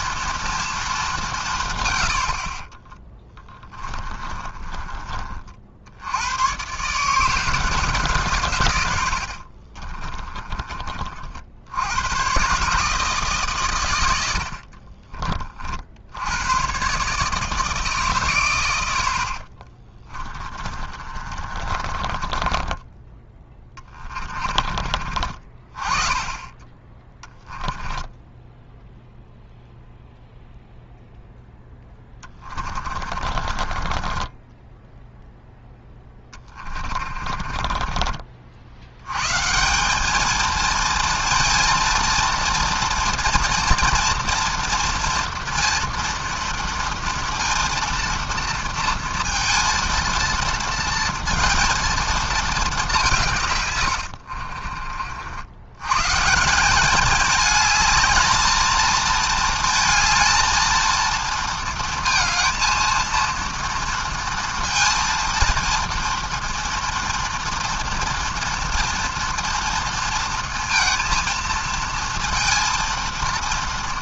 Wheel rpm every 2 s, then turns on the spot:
230, 50, 30, 120, 120, 30, 140, 50, 120, 100, 30, 20, 30, 20, 10, 0, 30, 10, 20, 80, 230, 240, 230, 230, 230, 230, 200, 40, 190, 220, 230, 230, 230, 230, 230, 230, 230.
4-6 14-16 20-24 32-38 54-56